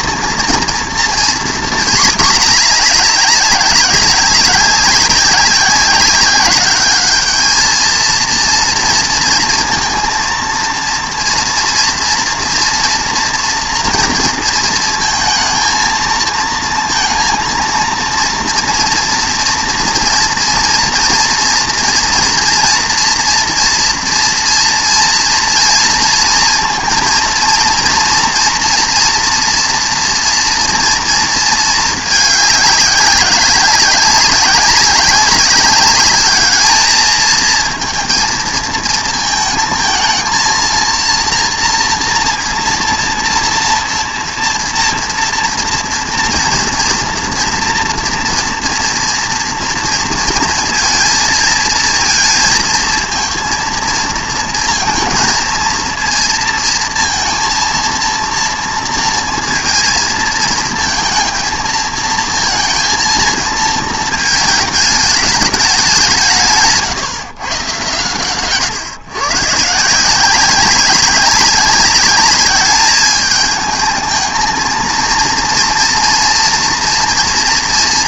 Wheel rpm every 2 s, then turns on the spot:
230, 210, 200, 210, 230, 230, 230, 230, 230, 230, 230, 240, 230, 230, 230, 230, 200, 190, 220, 220, 230, 240, 230, 240, 230, 230, 230, 230, 230, 230, 230, 230, 210, 140, 130, 190, 210, 230, 230.
none